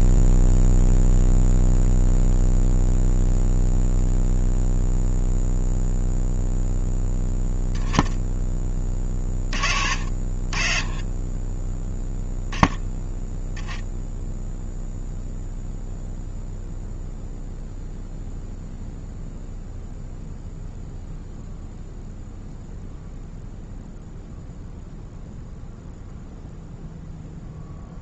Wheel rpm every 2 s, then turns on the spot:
0, 0, 0, 0, 20, 40, 0, 0, 0, 0, 0, 0, 0, 0.
none